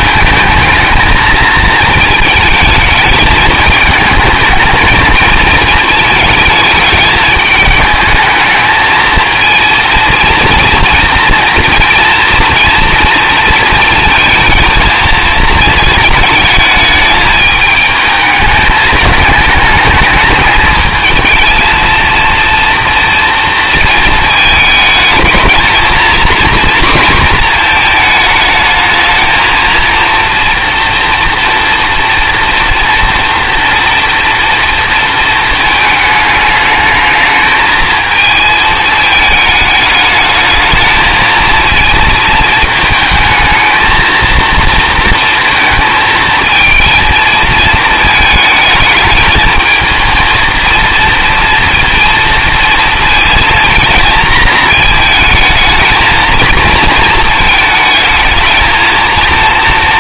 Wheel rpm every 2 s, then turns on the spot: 220, 220, 220, 220, 220, 230, 230, 230, 210, 220, 220, 230, 220, 240, 220, 240, 230, 230, 210, 220, 220, 220, 230, 230, 220, 230, 230, 220, 230, 220.
none